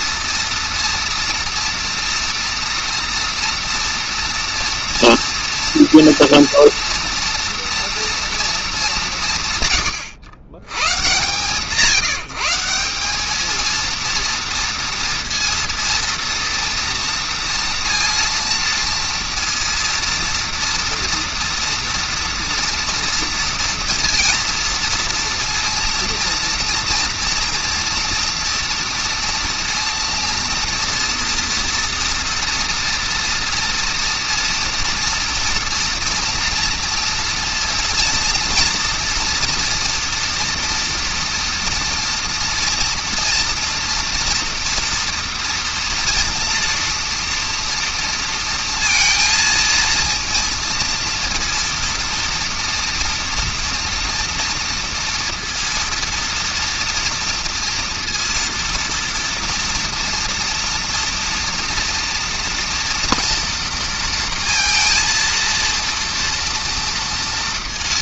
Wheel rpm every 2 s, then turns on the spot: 230, 230, 230, 230, 230, 110, 170, 230, 230, 230, 230, 230, 230, 230, 230, 230, 230, 230, 230, 230, 240, 230, 240, 230, 230, 230, 230, 230, 230, 230, 230, 230, 230, 230.
none